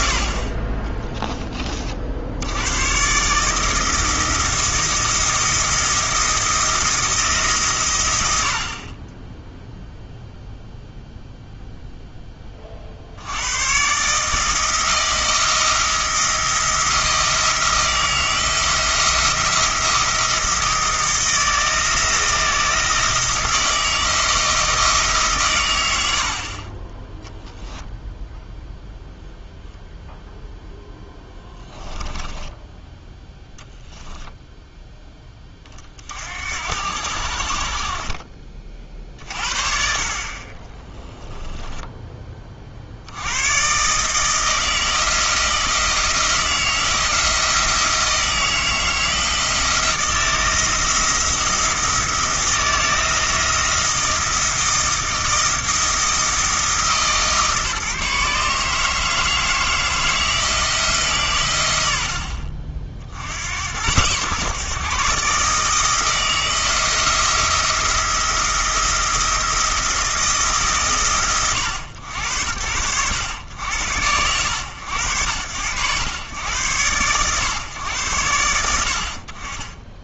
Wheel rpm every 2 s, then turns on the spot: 30, 110, 170, 170, 40, 0, 50, 160, 170, 170, 170, 170, 160, 30, 0, 0, 0, 0, 70, 40, 20, 40, 160, 160, 160, 160, 170, 170, 160, 150, 160, 60, 130, 170, 170, 130, 90, 90, 110, 80.
40-42